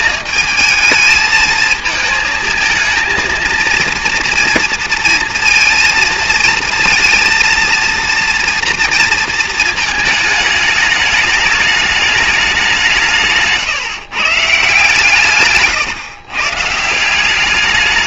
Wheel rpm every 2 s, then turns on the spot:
220, 220, 230, 230, 230, 210, 180, 150, 150.
none